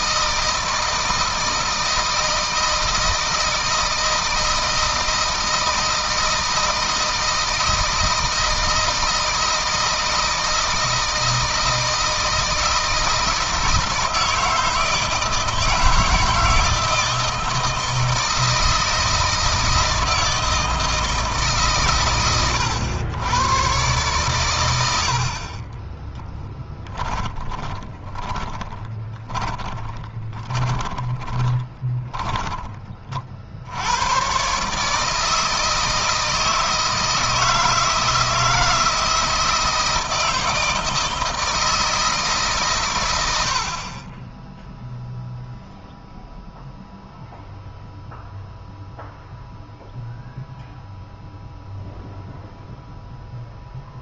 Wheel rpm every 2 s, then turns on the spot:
160, 160, 160, 160, 160, 160, 160, 160, 160, 160, 160, 100, 90, 10, 20, 20, 30, 150, 160, 160, 160, 120, 0, 0, 0, 0, 0.
26-32